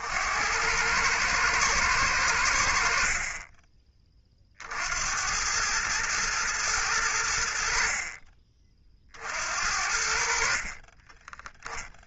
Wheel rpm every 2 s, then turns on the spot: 100, 60, 70, 100, 40, 30.
10-12